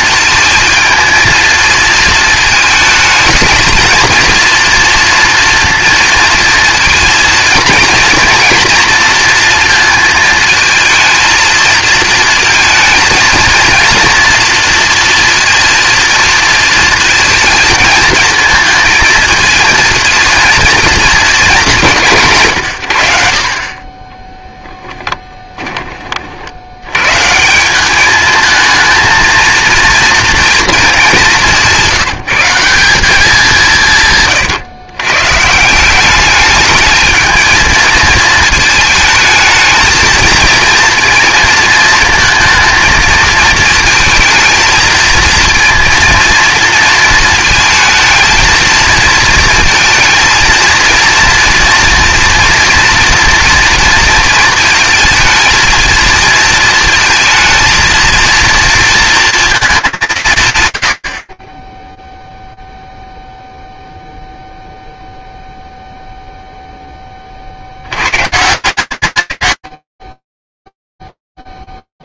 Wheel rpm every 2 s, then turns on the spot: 220, 220, 230, 230, 230, 230, 230, 230, 220, 220, 230, 130, 10, 70, 220, 230, 180, 130, 210, 220, 230, 230, 220, 230, 230, 230, 230, 230, 230, 230, 120, 0, 0, 40, 170, 10.
24-26 70-72